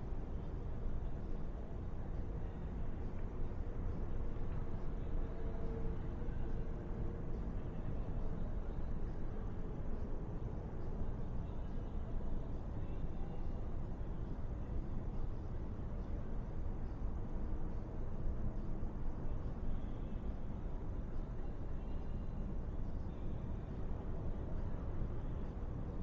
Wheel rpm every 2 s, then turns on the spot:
0, 0, 0, 0, 0, 0, 0, 0, 0, 0, 0, 0, 0.
none